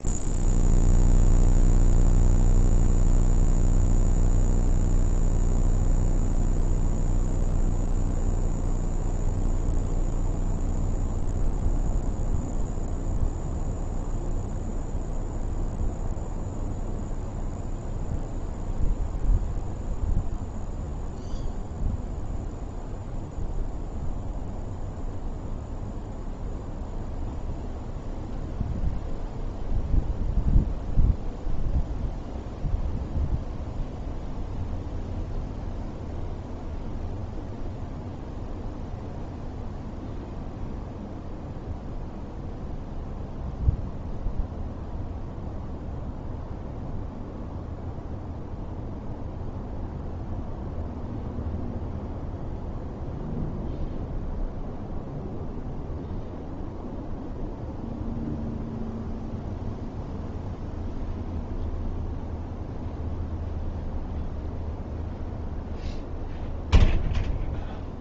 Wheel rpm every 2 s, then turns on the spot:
0, 0, 0, 0, 0, 0, 0, 0, 0, 0, 0, 0, 0, 0, 0, 0, 0, 0, 0, 0, 0, 0, 0, 0, 0, 0, 0, 0, 0, 0, 0, 0, 0, 0.
none